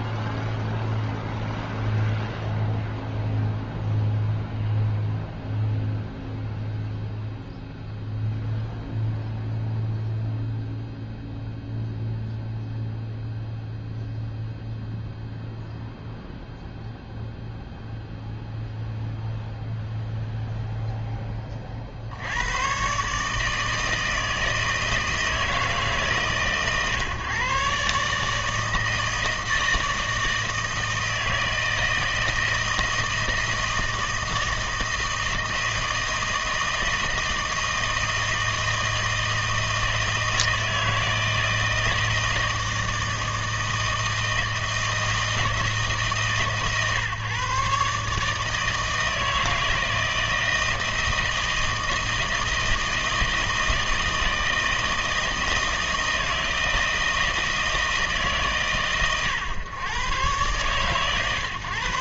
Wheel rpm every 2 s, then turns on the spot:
0, 0, 0, 0, 0, 0, 0, 0, 0, 0, 10, 140, 160, 130, 160, 160, 160, 160, 160, 160, 160, 160, 160, 130, 160, 160, 160, 160, 160, 120, 130.
none